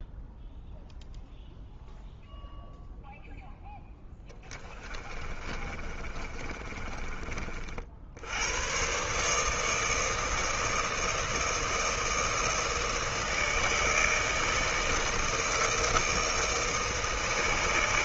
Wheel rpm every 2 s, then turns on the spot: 0, 0, 20, 30, 130, 160, 160, 160, 160.
4-8